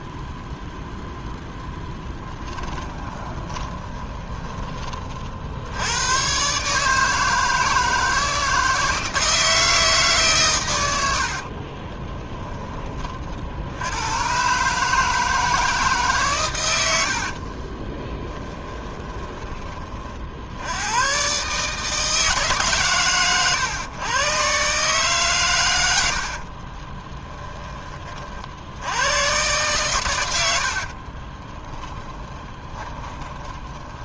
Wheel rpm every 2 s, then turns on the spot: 0, 10, 30, 150, 160, 100, 20, 150, 90, 10, 90, 130, 130, 30, 80, 70, 30.
2-4 16-20 26-28 30-34